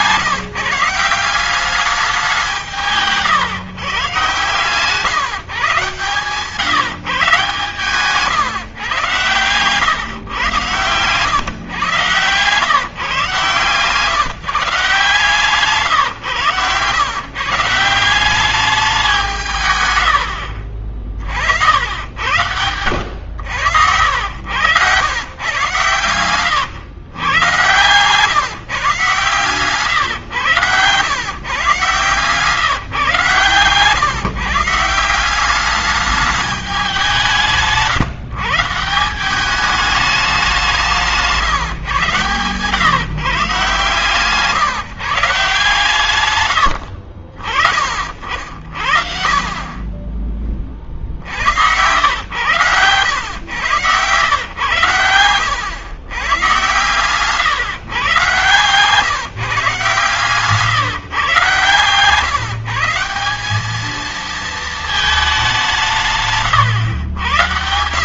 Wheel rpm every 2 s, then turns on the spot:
150, 180, 130, 140, 120, 110, 130, 140, 130, 190, 80, 90, 100, 120, 150, 120, 150, 140, 200, 150, 190, 120, 140, 110, 50, 30, 100, 110, 120, 130, 140, 150, 220, 140.
24-26 30-32 58-60